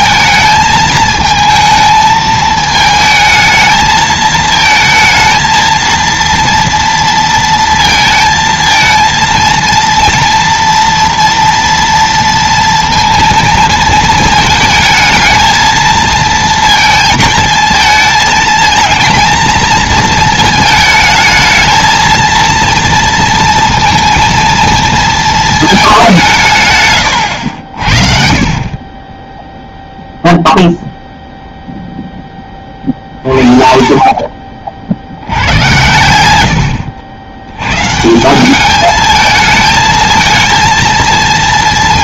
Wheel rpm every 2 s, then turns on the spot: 220, 220, 220, 230, 230, 230, 230, 220, 230, 220, 220, 230, 230, 130, 20, 0, 30, 60, 70, 210, 230.
none